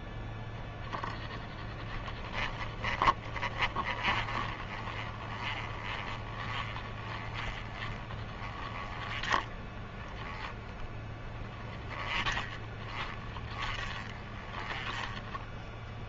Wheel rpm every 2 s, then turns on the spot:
10, 20, 20, 20, 20, 10, 20, 20.
2-16